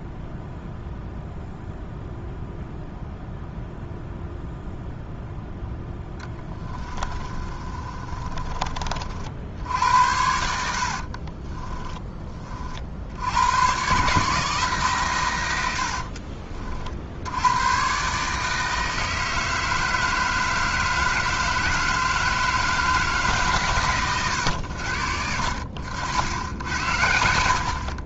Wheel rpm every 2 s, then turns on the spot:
0, 0, 0, 20, 40, 60, 50, 150, 50, 160, 160, 160, 90, 90.
6-8 10-12